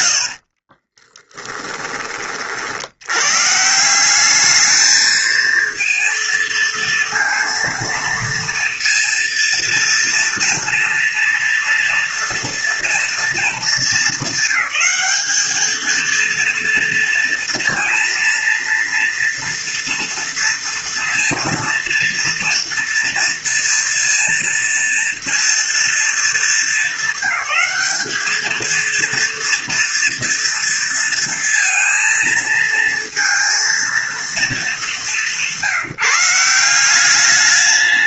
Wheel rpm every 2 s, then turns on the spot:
20, 90, 220, 230, 230, 230, 230, 210, 230, 230, 230, 230, 230, 220, 230, 230, 230, 200, 180.
0-2